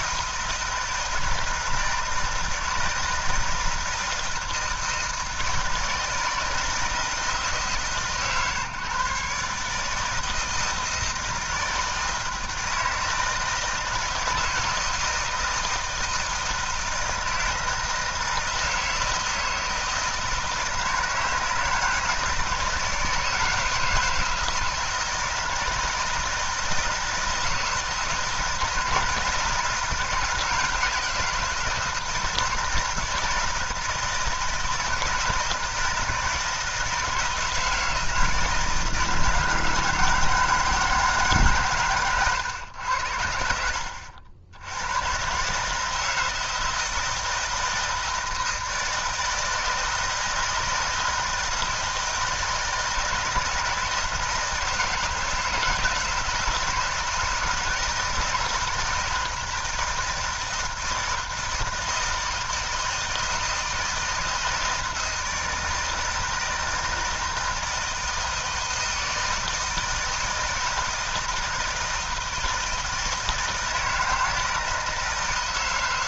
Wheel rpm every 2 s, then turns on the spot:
160, 160, 160, 160, 140, 160, 160, 160, 160, 160, 160, 160, 160, 160, 160, 160, 160, 160, 160, 160, 160, 90, 100, 160, 160, 160, 160, 170, 160, 160, 160, 160, 160, 160, 160, 160, 160, 160.
none